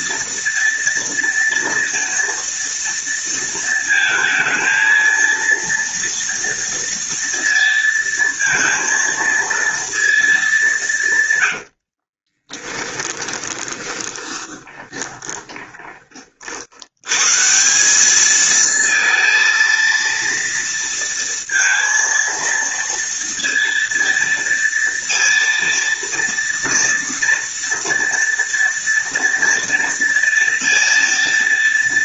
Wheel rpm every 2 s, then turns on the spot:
230, 230, 230, 230, 230, 140, 20, 20, 110, 230, 230, 230, 230, 230, 230, 230.
10-16